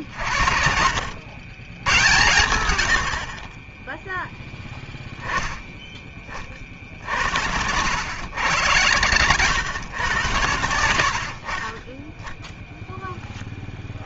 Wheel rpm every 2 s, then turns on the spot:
60, 100, 10, 40, 120, 90, 0.
none